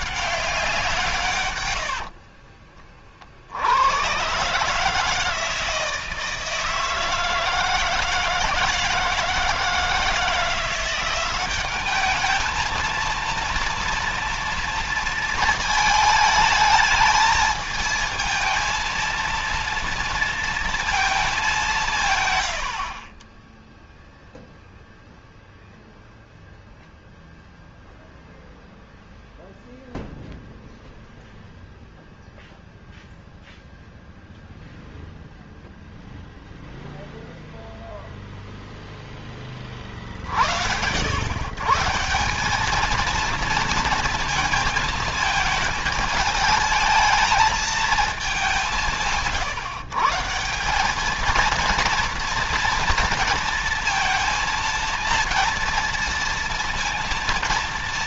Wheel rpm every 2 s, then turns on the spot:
100, 80, 160, 160, 160, 190, 230, 220, 220, 230, 210, 30, 0, 0, 0, 0, 0, 0, 0, 0, 80, 220, 220, 220, 170, 190, 230, 230, 230.
0-2